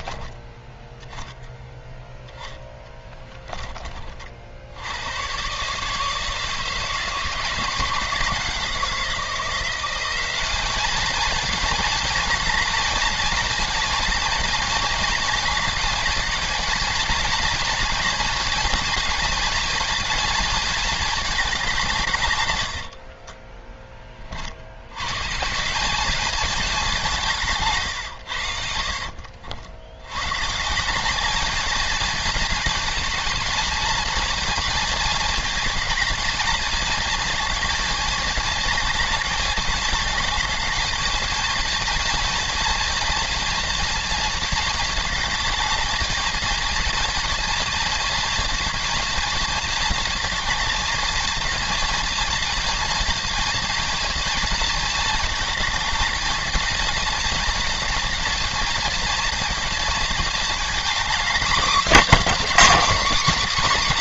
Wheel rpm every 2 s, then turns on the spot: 10, 10, 70, 160, 170, 200, 220, 220, 220, 230, 220, 100, 90, 200, 70, 170, 220, 230, 220, 220, 210, 230, 220, 220, 230, 220, 220, 220, 220, 230, 230, 290.
2-4 28-30